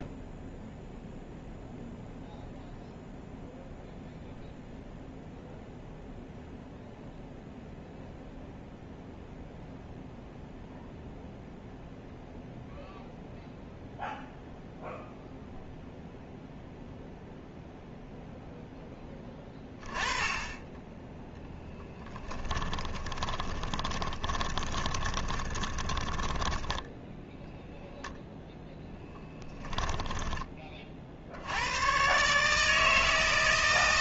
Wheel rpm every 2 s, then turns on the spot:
0, 0, 0, 0, 0, 0, 0, 0, 0, 0, 20, 30, 20, 10, 0, 20, 140.
22-28